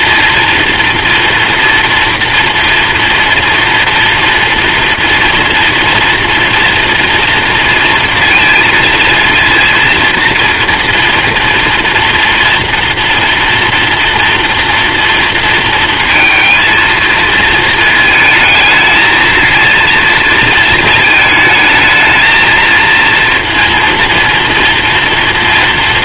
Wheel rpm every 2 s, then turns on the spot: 240, 230, 230, 230, 230, 230, 230, 230, 230, 230, 220, 230, 230.
none